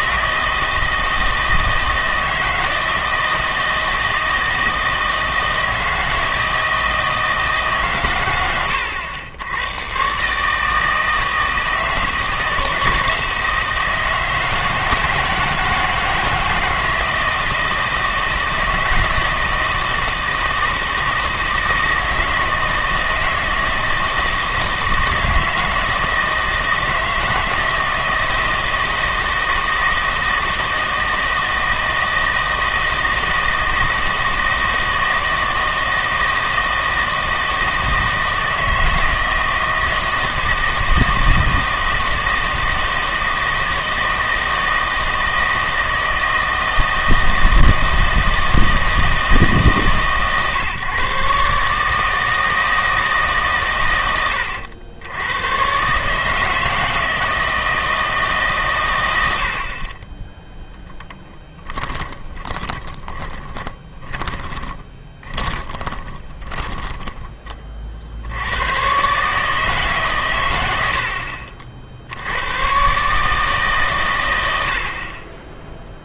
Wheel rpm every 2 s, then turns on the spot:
160, 160, 160, 160, 100, 160, 160, 160, 160, 160, 160, 160, 160, 160, 160, 160, 160, 160, 160, 160, 160, 160, 160, 160, 160, 140, 160, 90, 160, 120, 0, 20, 20, 10, 120, 80, 130, 50.
62-68